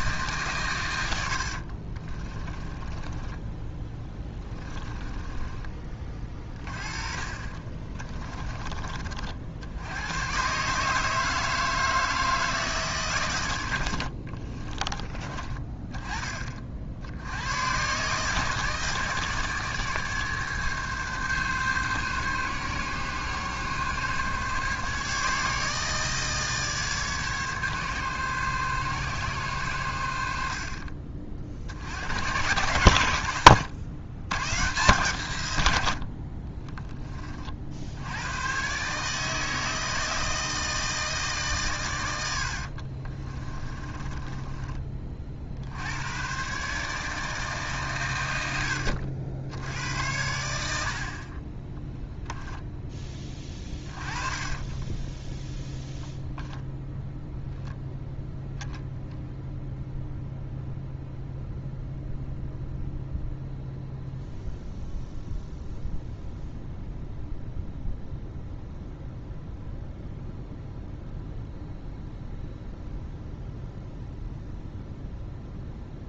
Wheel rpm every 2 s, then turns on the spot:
130, 20, 20, 30, 30, 150, 150, 20, 60, 150, 140, 140, 150, 150, 140, 50, 110, 120, 20, 140, 160, 50, 20, 150, 90, 70, 10, 30, 0, 0, 0, 0, 0, 0, 0, 0, 0, 0.
2-8 42-44 54-56